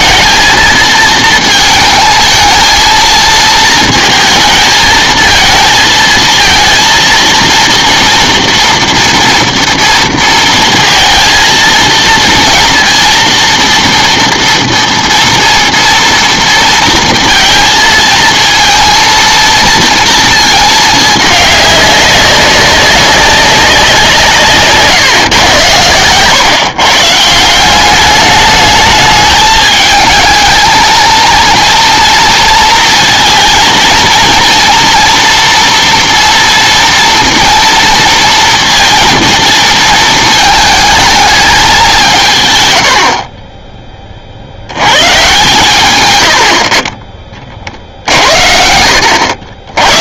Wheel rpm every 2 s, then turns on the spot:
220, 220, 220, 230, 230, 230, 230, 240, 230, 230, 220, 200, 150, 130, 210, 220, 230, 240, 230, 230, 220, 120, 80, 50, 70.
none